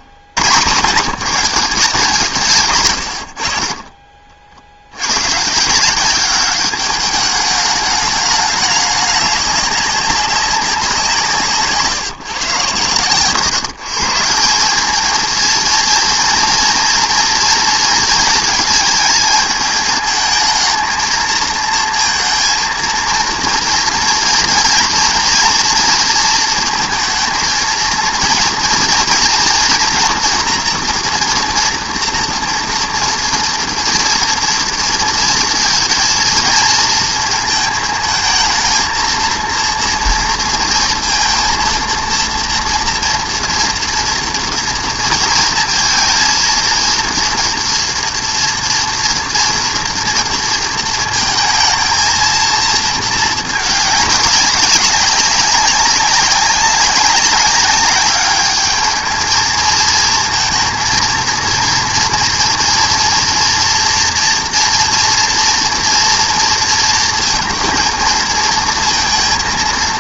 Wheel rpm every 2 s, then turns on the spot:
100, 140, 60, 200, 210, 190, 130, 180, 230, 220, 230, 230, 230, 230, 230, 230, 230, 230, 220, 220, 230, 230, 230, 230, 240, 230, 230, 200, 190, 210, 230, 240, 230, 230, 230.
none